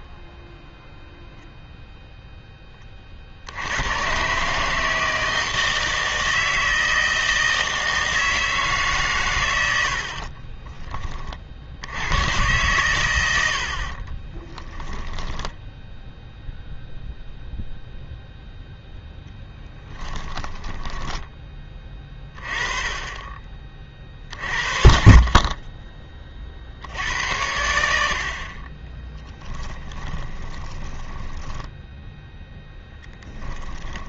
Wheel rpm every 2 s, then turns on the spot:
0, 10, 150, 160, 150, 30, 110, 10, 0, 0, 10, 30, 50, 60, 20, 20, 10.
10-12 14-16 28-34